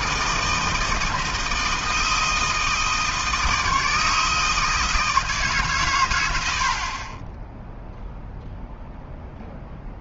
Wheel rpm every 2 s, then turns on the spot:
160, 160, 160, 70, 0.
none